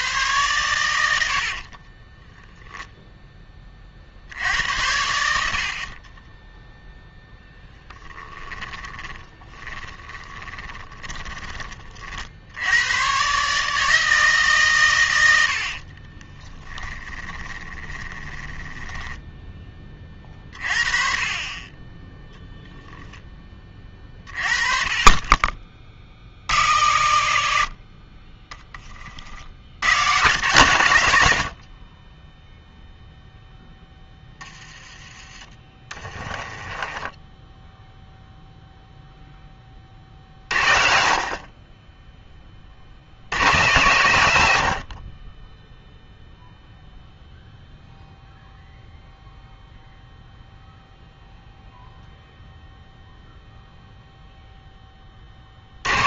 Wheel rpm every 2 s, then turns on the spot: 110, 0, 70, 0, 10, 20, 100, 130, 20, 10, 30, 0, 30, 80, 20, 140, 0, 20, 20, 0, 60, 50, 70, 0, 0, 0, 0, 10.
8-12 16-20 36-38